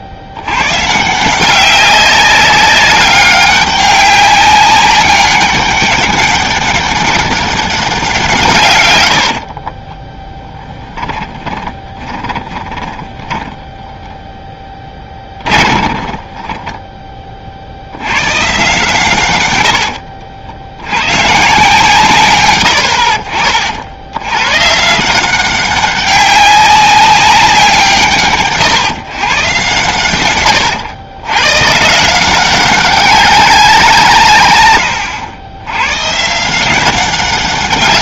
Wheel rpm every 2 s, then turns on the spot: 130, 200, 200, 200, 120, 10, 10, 10, 10, 130, 90, 100, 130, 190, 130, 110, 190, 110, 170.
10-18